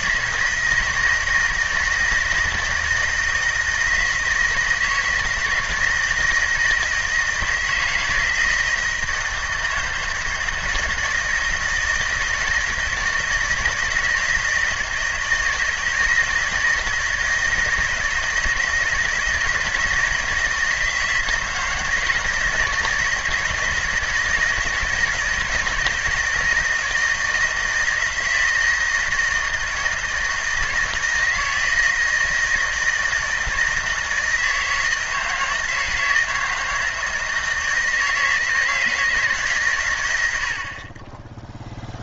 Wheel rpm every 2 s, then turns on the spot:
160, 160, 160, 160, 160, 160, 160, 170, 160, 160, 160, 160, 160, 160, 160, 160, 160, 160, 160, 160, 50.
none